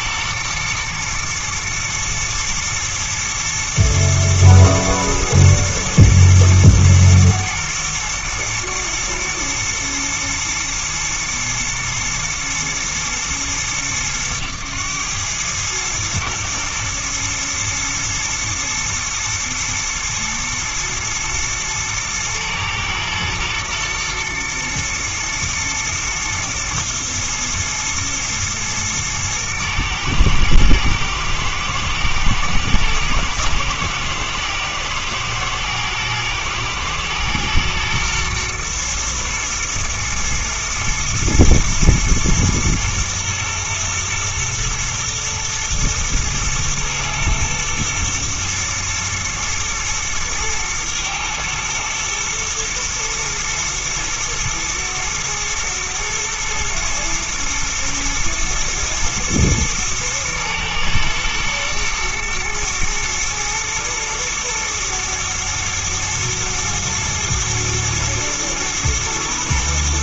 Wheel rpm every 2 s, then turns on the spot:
120, 110, 120, 120, 120, 120, 110, 110, 110, 110, 110, 110, 110, 110, 120, 110, 120, 110, 110, 120, 120, 110, 120, 110, 120, 110, 120, 110, 110, 110, 110, 120, 120, 110, 120.
none